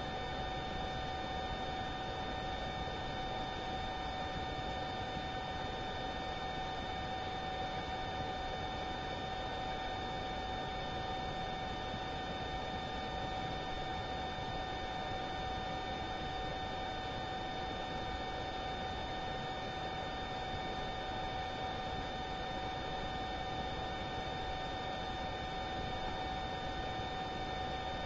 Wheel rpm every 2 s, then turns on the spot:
0, 0, 0, 0, 0, 0, 0, 0, 0, 0, 0, 0, 0, 0.
none